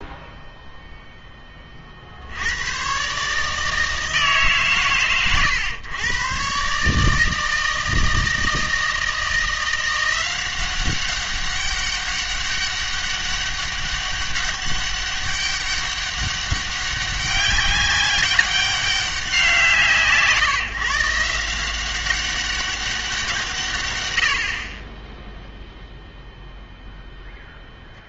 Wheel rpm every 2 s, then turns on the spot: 0, 110, 130, 140, 160, 190, 200, 200, 190, 200, 160, 200, 40, 0.
none